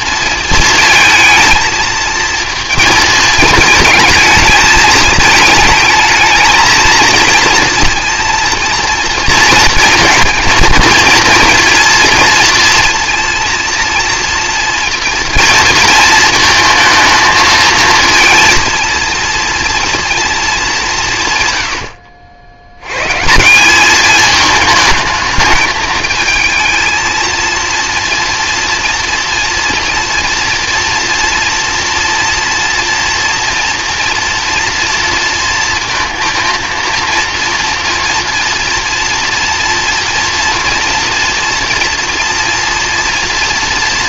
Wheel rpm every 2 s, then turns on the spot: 230, 230, 220, 220, 230, 230, 230, 240, 220, 230, 200, 100, 220, 230, 230, 230, 230, 230, 230, 230, 230, 230.
none